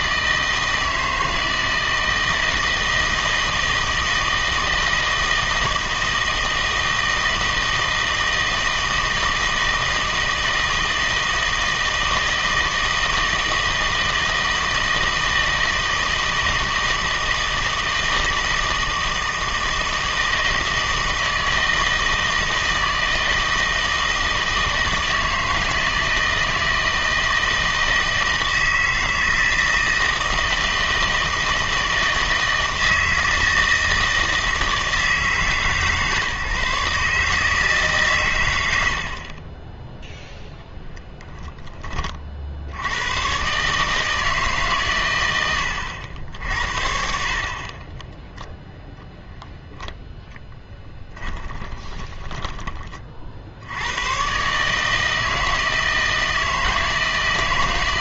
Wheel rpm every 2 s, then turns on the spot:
160, 160, 160, 160, 160, 160, 160, 160, 160, 160, 160, 160, 160, 160, 160, 160, 160, 160, 150, 100, 0, 80, 140, 70, 0, 10, 20, 140, 160.
50-52